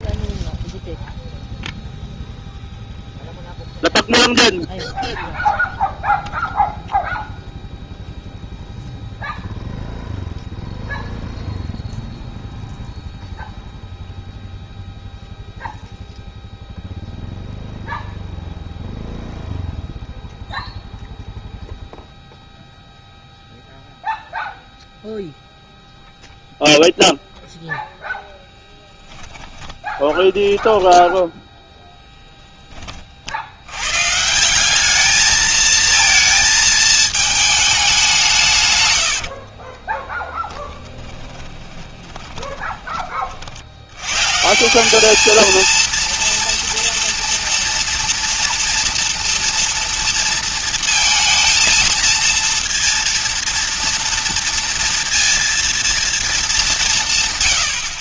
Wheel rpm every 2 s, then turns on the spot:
0, 0, 0, 0, 0, 0, 0, 0, 0, 0, 0, 0, 0, 0, 10, 10, 10, 180, 220, 140, 10, 30, 160, 230, 230, 230, 230, 230, 190.
28-32 40-44